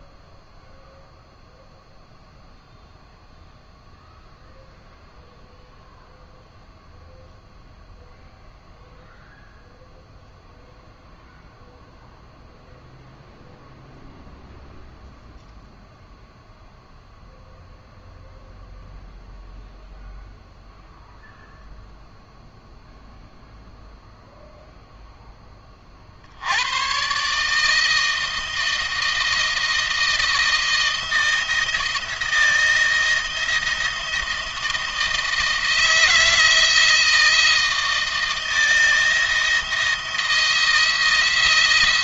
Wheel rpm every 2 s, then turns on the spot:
0, 0, 0, 0, 0, 0, 0, 0, 0, 0, 0, 0, 0, 110, 160, 170, 160, 160, 160, 170, 170.
none